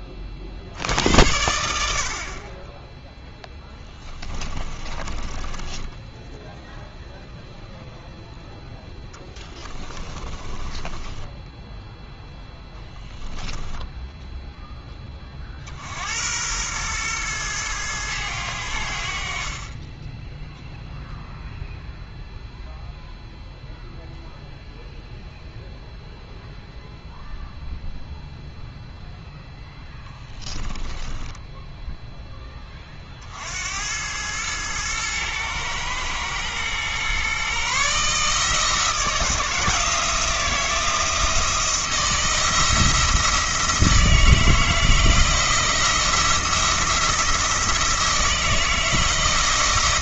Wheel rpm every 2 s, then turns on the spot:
80, 10, 20, 0, 20, 0, 10, 100, 90, 0, 0, 0, 0, 0, 10, 10, 100, 110, 150, 160, 160, 160, 170, 170, 170.
2-6 8-10 28-30